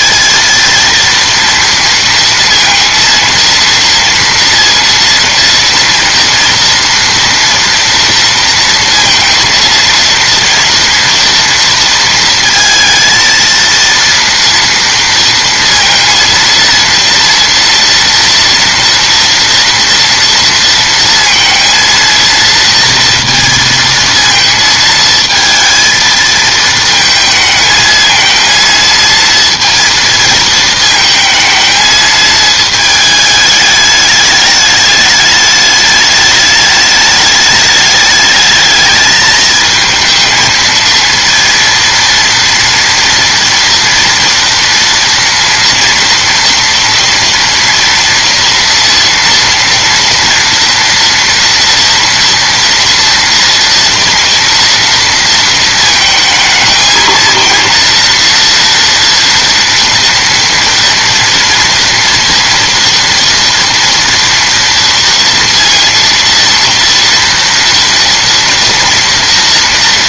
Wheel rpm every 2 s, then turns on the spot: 230, 230, 230, 230, 230, 230, 230, 230, 230, 230, 230, 230, 220, 220, 230, 220, 220, 210, 210, 210, 230, 240, 230, 230, 230, 230, 230, 230, 220, 230, 240, 230, 230, 230, 230.
none